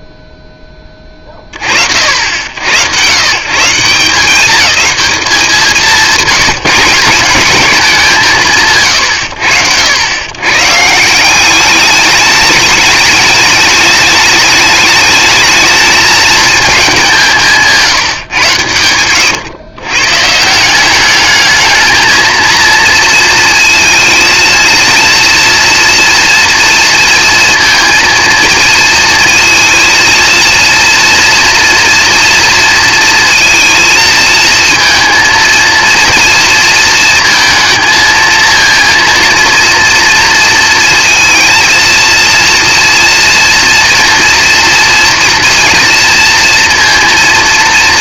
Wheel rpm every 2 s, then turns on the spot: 0, 90, 210, 180, 100, 110, 210, 210, 220, 120, 170, 230, 230, 230, 230, 230, 230, 230, 230, 230, 230, 230, 240, 230.
none